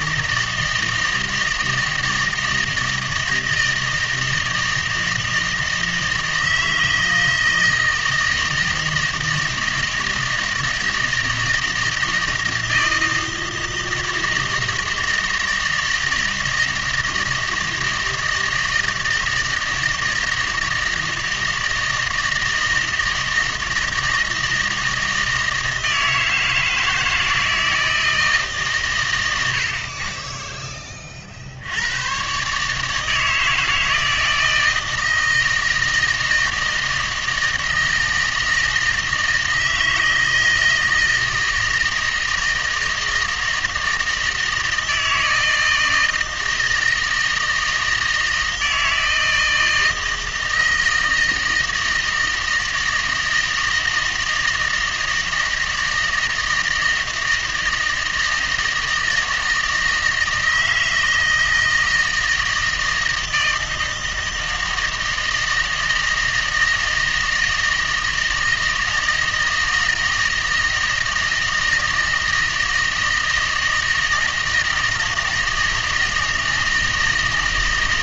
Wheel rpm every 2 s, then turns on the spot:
160, 160, 160, 160, 160, 160, 160, 160, 160, 160, 160, 160, 160, 160, 130, 10, 150, 160, 160, 160, 160, 160, 160, 160, 160, 160, 160, 160, 160, 160, 160, 160, 160, 160, 160, 160, 160, 160, 160.
none